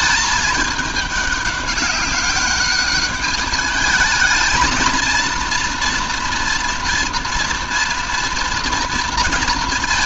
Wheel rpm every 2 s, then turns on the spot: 210, 200, 220, 230, 230.
none